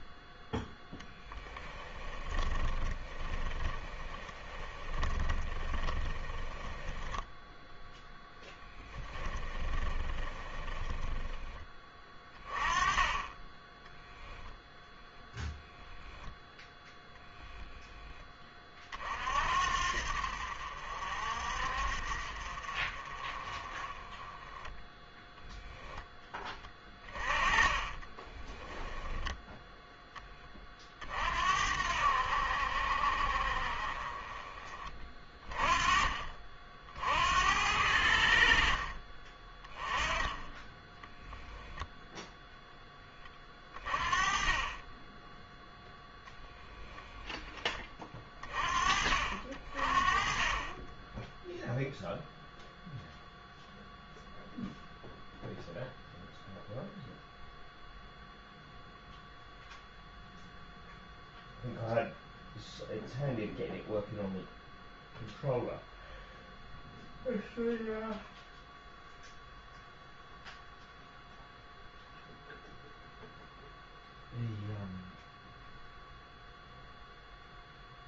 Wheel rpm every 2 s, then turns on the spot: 10, 20, 20, 10, 10, 20, 20, 0, 0, 30, 60, 40, 10, 20, 20, 40, 60, 30, 50, 50, 10, 10, 20, 0, 40, 20, 0, 0, 0, 0, 0, 0, 0, 0, 0, 0, 0, 0, 0.
2-12 26-30